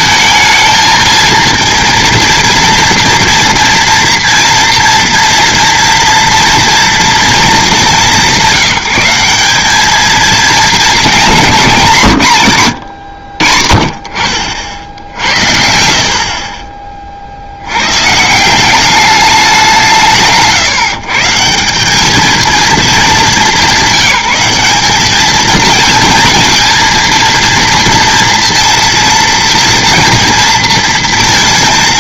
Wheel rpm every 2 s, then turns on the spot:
220, 230, 230, 230, 190, 220, 150, 60, 40, 170, 150, 220, 200, 230, 230, 230.
none